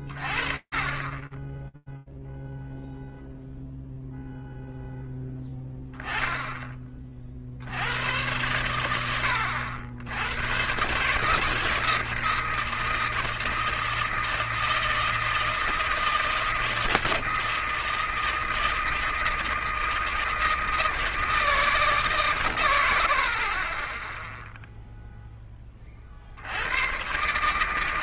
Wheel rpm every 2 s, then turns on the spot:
10, 0, 10, 100, 100, 160, 160, 160, 160, 160, 100, 0, 90, 90.
none